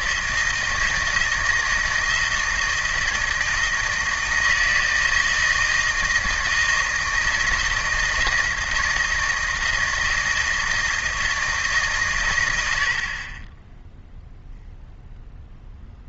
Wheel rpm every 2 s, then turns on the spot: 160, 160, 160, 160, 160, 160, 70, 0.
none